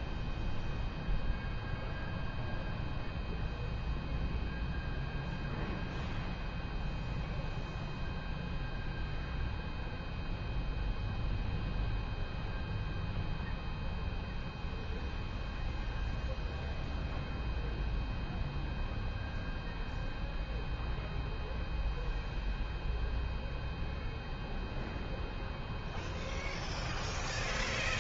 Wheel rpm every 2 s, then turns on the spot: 0, 0, 0, 0, 0, 0, 0, 0, 0, 0, 0, 0, 0, 0.
none